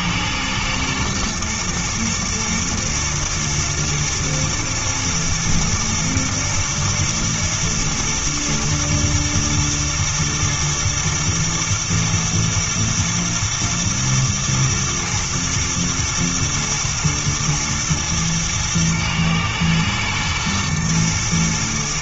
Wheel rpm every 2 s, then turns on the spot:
120, 120, 120, 110, 120, 120, 120, 110, 120, 110, 110.
none